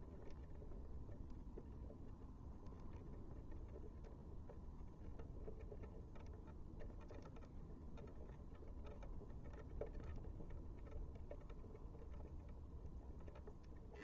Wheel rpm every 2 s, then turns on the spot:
0, 0, 0, 0, 0, 0, 20.
none